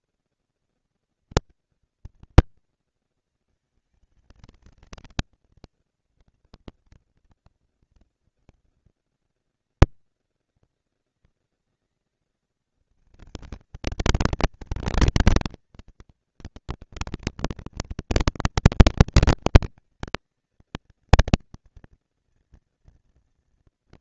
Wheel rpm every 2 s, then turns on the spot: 230, 230, 220, 230, 220, 190, 200, 220, 220, 230, 230, 230.
none